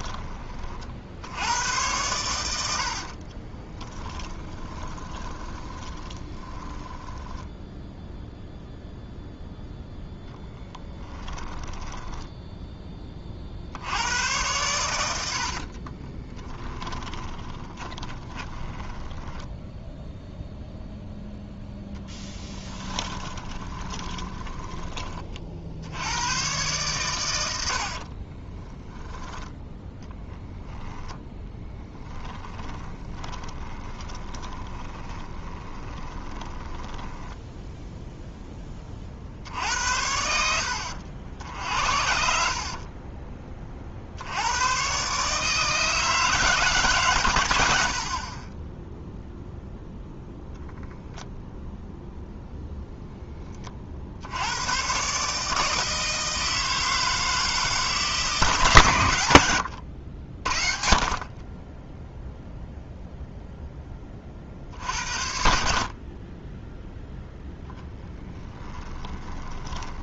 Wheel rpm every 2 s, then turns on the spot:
40, 80, 20, 10, 0, 10, 10, 110, 10, 20, 0, 10, 20, 120, 20, 0, 10, 20, 10, 20, 70, 50, 110, 150, 10, 0, 0, 100, 160, 140, 50, 0, 70, 10, 10.
2-8 10-12 16-20 22-26 28-30 32-38 42-44 68-70